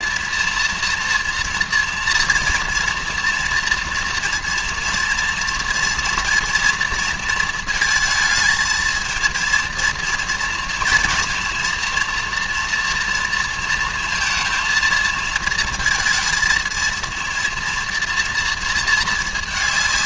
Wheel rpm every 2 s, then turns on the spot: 230, 240, 230, 230, 220, 230, 230, 230, 230, 220.
none